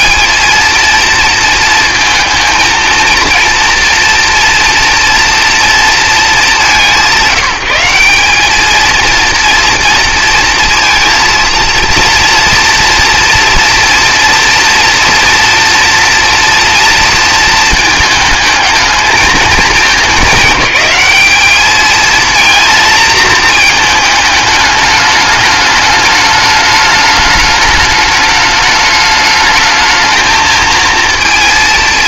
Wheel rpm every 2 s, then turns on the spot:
120, 230, 230, 210, 190, 230, 230, 230, 230, 220, 200, 220, 220, 210, 210, 220.
none